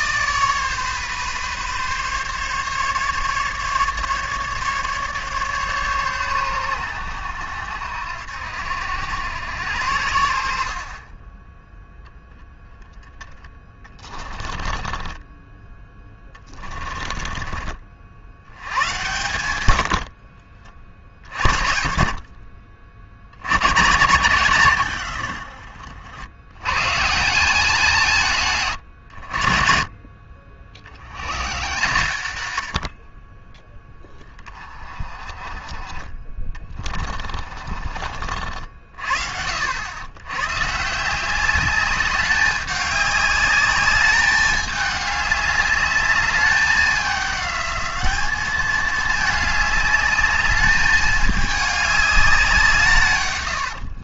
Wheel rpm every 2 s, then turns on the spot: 140, 140, 150, 110, 80, 60, 10, 20, 20, 100, 50, 60, 120, 120, 150, 50, 80, 20, 30, 60, 140, 200, 210, 200, 210, 210, 160.
14-18 28-30 36-38